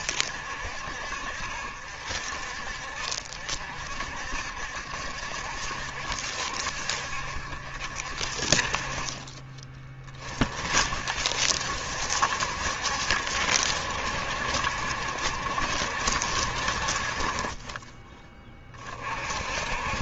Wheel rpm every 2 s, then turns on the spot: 60, 50, 70, 60, 40, 50, 70, 70, 50, 30.
none